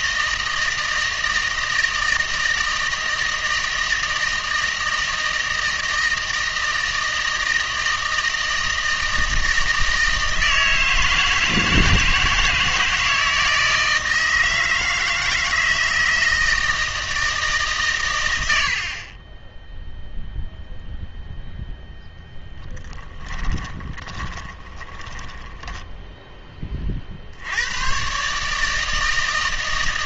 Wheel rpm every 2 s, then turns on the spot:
160, 160, 160, 160, 160, 160, 160, 160, 160, 80, 0, 10, 20, 30, 150.
22-26